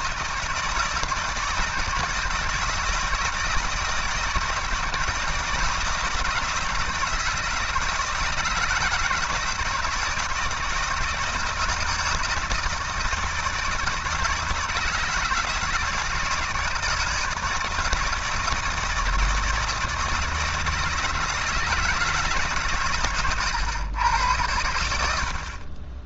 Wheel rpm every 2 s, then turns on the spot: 160, 160, 160, 160, 160, 170, 160, 160, 170, 160, 160, 130, 100.
none